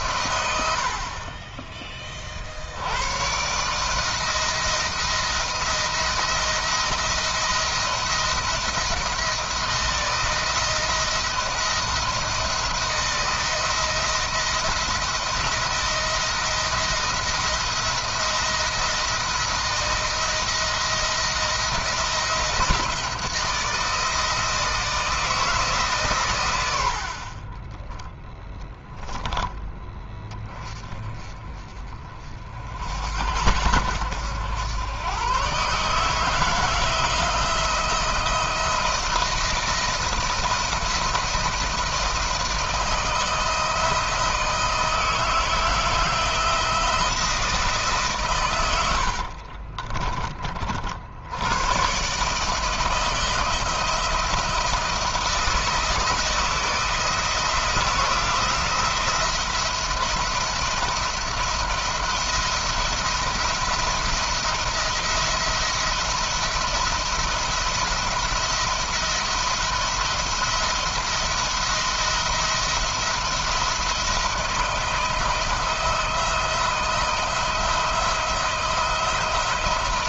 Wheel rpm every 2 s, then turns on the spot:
50, 100, 170, 170, 170, 170, 170, 170, 170, 160, 170, 170, 160, 70, 10, 30, 70, 110, 160, 170, 170, 170, 160, 170, 70, 70, 160, 170, 170, 170, 170, 170, 170, 170, 160, 160, 170, 170, 170, 170.
48-50